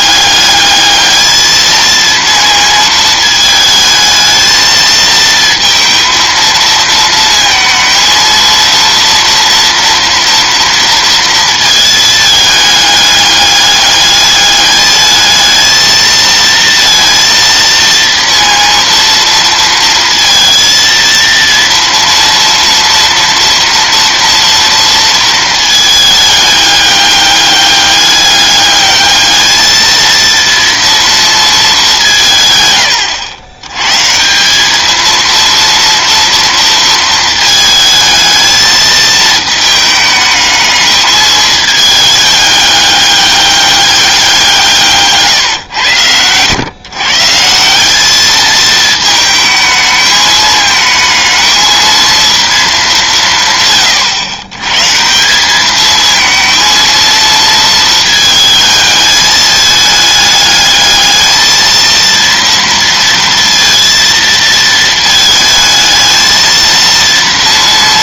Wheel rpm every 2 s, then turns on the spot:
210, 230, 230, 230, 230, 230, 210, 210, 230, 230, 230, 230, 230, 210, 210, 230, 140, 200, 230, 220, 210, 200, 160, 120, 220, 220, 210, 130, 220, 220, 210, 230, 230, 230.
none